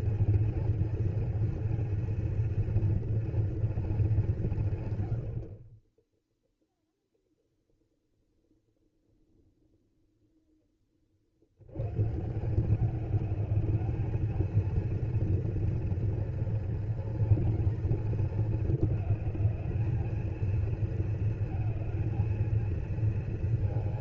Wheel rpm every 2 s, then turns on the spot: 230, 230, 140, 0, 0, 20, 200, 220, 230, 220, 230, 230.
none